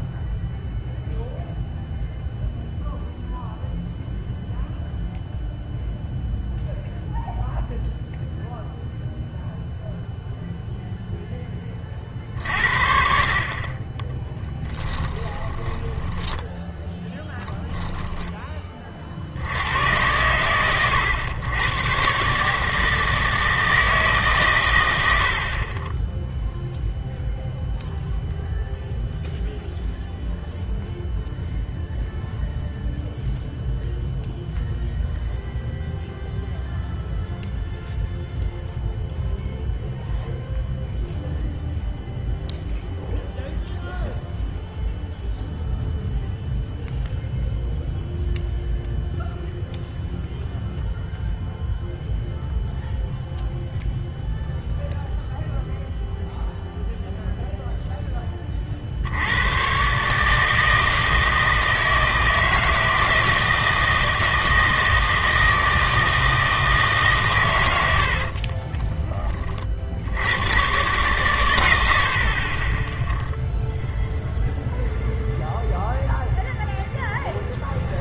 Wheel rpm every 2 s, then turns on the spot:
0, 0, 0, 0, 0, 0, 60, 10, 0, 30, 100, 160, 110, 0, 0, 0, 0, 0, 0, 0, 0, 0, 0, 0, 0, 0, 0, 0, 0, 40, 160, 160, 160, 160, 20, 110, 10, 0, 0.
14-16 68-70